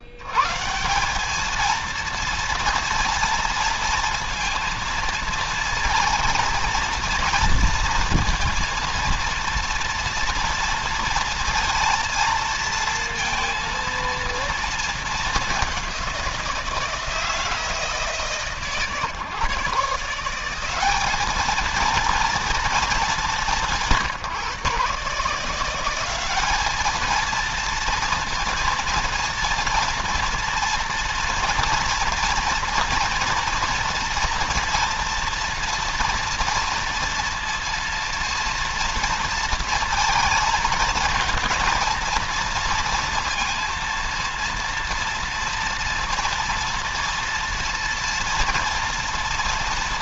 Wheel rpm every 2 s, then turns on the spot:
190, 230, 230, 230, 230, 230, 230, 220, 170, 140, 200, 210, 150, 220, 230, 230, 230, 230, 230, 230, 230, 230, 230, 230, 230.
none